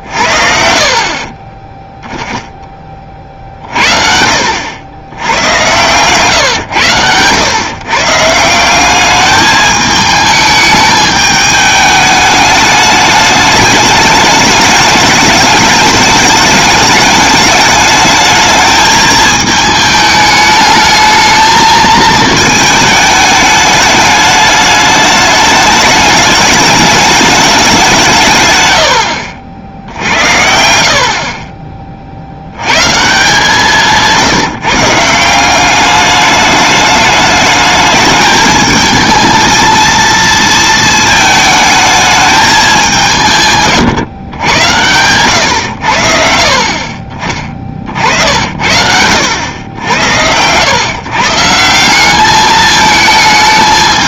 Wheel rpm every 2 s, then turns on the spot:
50, 30, 90, 110, 190, 210, 210, 210, 210, 220, 210, 220, 210, 220, 110, 60, 130, 150, 210, 220, 220, 190, 100, 30, 70, 120, 220.
none